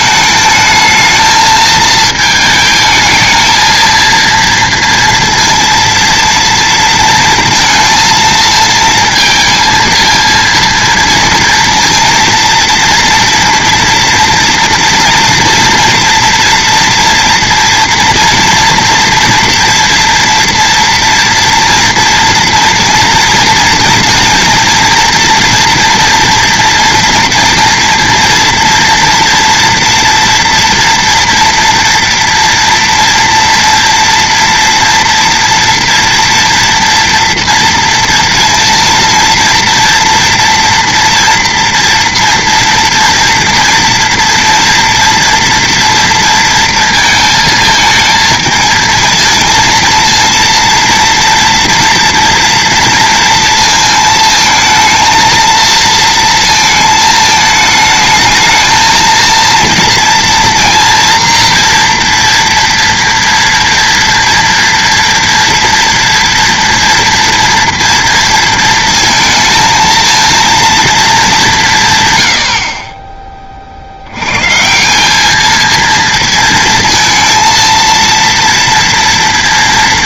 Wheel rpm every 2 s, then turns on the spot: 220, 220, 230, 230, 230, 230, 230, 230, 230, 230, 230, 230, 230, 230, 230, 230, 230, 230, 230, 230, 230, 230, 240, 230, 220, 230, 230, 230, 230, 220, 230, 230, 230, 230, 230, 230, 70, 130, 230, 230.
none